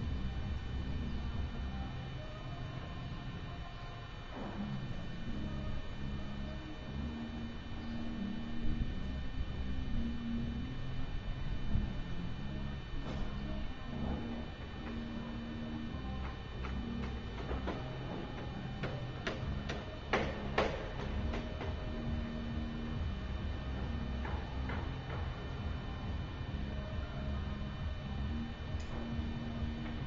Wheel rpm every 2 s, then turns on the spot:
0, 0, 0, 0, 0, 0, 0, 0, 0, 0, 0, 0, 0, 0, 0.
none